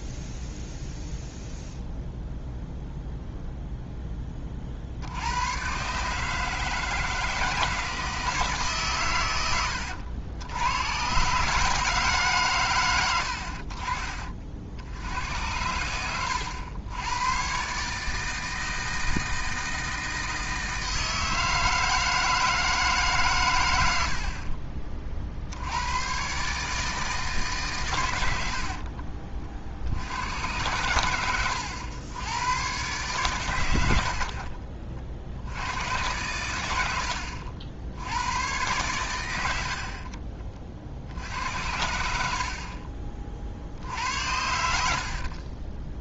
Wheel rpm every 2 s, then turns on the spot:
0, 0, 40, 160, 150, 100, 120, 60, 100, 160, 160, 160, 50, 150, 70, 100, 90, 30, 100, 110, 40, 50, 80.
28-30